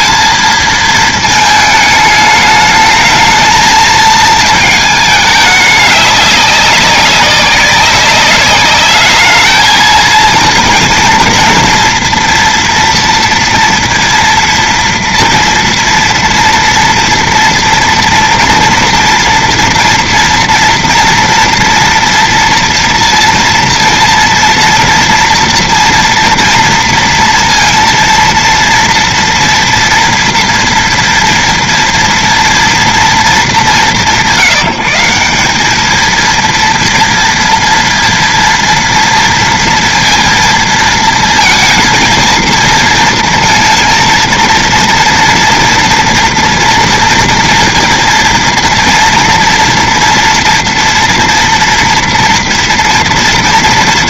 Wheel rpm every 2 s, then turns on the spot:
220, 210, 220, 200, 200, 230, 230, 230, 230, 230, 230, 230, 230, 230, 230, 230, 230, 160, 230, 230, 230, 230, 230, 230, 230, 230, 230.
none